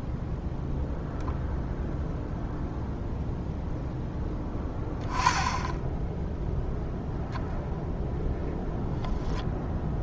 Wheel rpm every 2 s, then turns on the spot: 0, 0, 10, 0, 0.
none